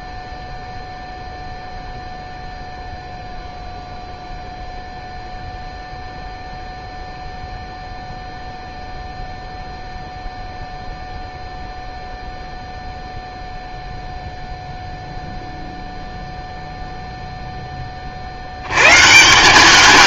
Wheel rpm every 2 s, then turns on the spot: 0, 0, 0, 0, 0, 0, 0, 0, 0, 100.
none